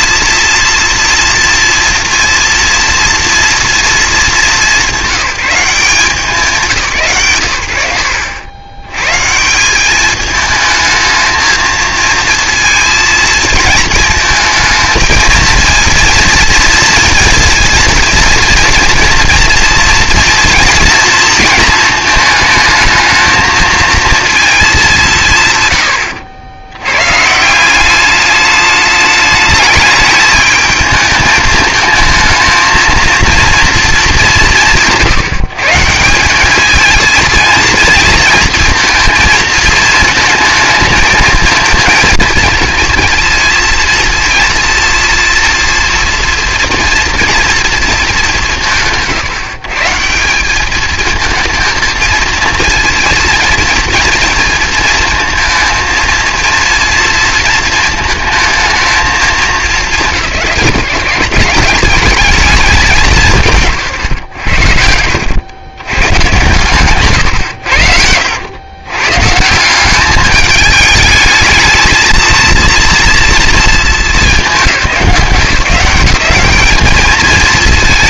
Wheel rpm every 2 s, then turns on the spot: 230, 230, 200, 170, 100, 220, 230, 220, 230, 230, 230, 220, 210, 90, 210, 210, 220, 160, 210, 230, 230, 220, 230, 230, 170, 200, 230, 230, 230, 220, 160, 200, 90, 130, 110, 210, 230, 180, 210.
none